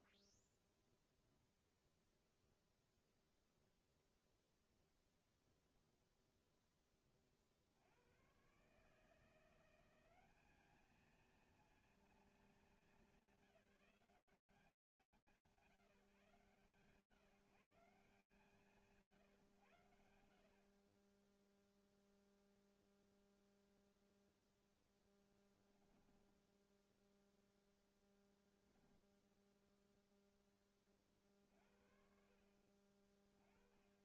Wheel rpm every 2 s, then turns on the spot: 0, 0, 0, 20, 160, 220, 210, 160, 120, 150, 0, 0, 10, 0, 0, 60, 20.
24-26